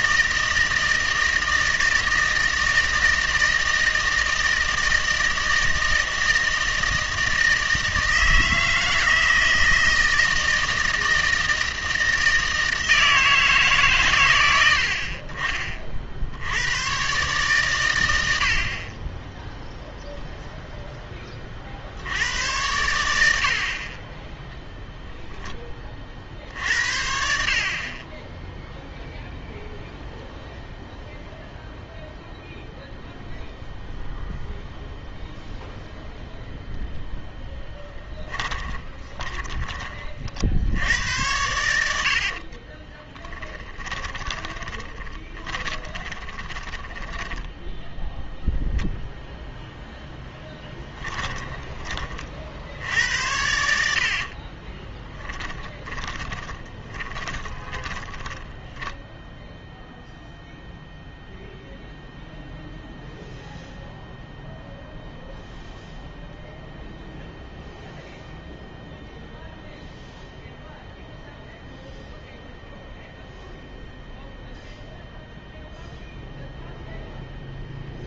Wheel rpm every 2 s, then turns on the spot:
160, 160, 160, 160, 160, 160, 160, 70, 110, 40, 0, 90, 0, 60, 0, 0, 0, 0, 0, 20, 70, 30, 20, 20, 0, 10, 70, 20, 20, 10, 0, 0, 0, 0, 0, 0, 0, 0, 0.
38-40 42-48 50-52 54-60